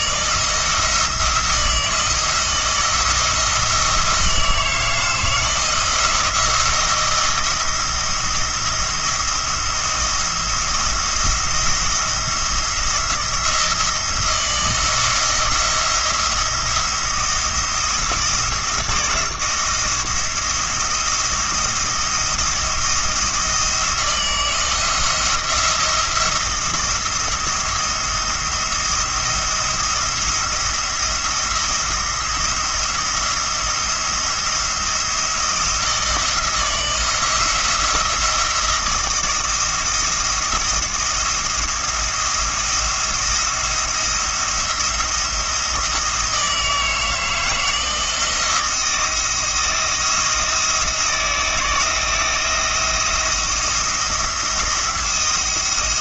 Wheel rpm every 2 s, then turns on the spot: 170, 160, 160, 170, 170, 170, 170, 170, 170, 170, 160, 160, 160, 170, 170, 170, 170, 170, 170, 170, 170, 170, 170, 160, 170, 170, 170, 170.
none